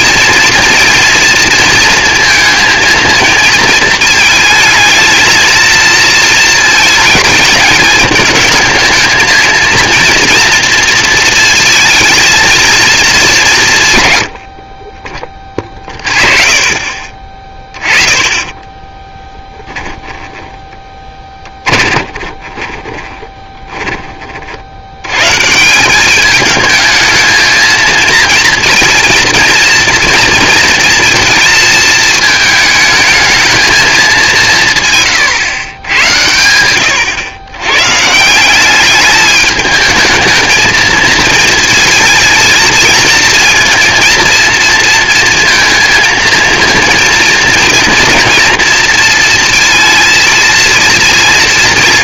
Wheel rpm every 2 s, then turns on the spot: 230, 230, 220, 220, 220, 230, 230, 60, 30, 20, 10, 20, 70, 210, 230, 230, 220, 160, 100, 190, 220, 220, 230, 230, 230, 230.
18-24